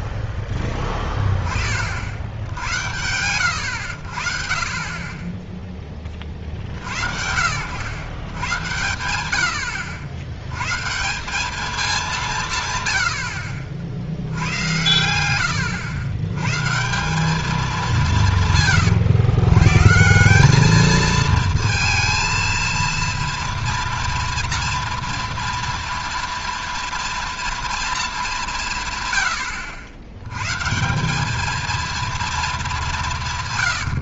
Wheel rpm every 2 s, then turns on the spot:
10, 80, 60, 70, 110, 100, 150, 100, 140, 150, 200, 230, 230, 230, 190, 130, 220.
none